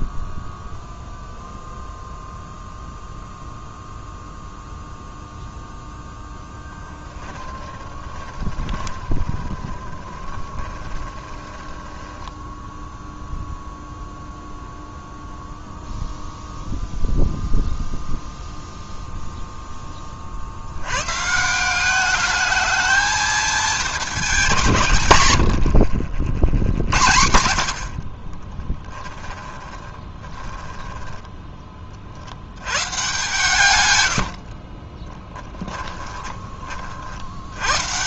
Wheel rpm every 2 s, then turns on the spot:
0, 0, 0, 10, 20, 20, 0, 0, 0, 0, 110, 220, 150, 80, 10, 10, 110, 20, 50.
6-12 26-32 34-36